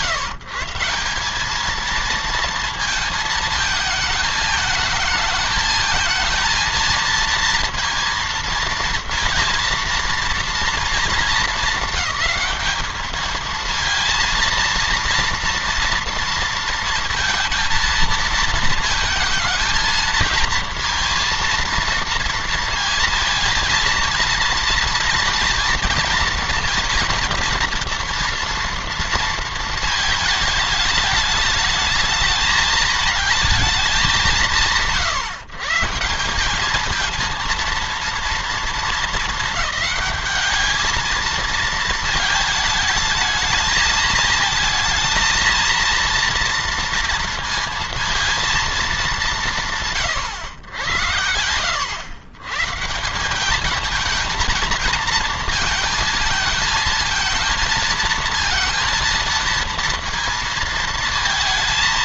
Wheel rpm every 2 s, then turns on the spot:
160, 230, 220, 230, 230, 220, 210, 230, 230, 220, 230, 230, 230, 230, 230, 220, 220, 140, 200, 220, 220, 210, 220, 230, 210, 110, 150, 220, 220, 230, 220.
none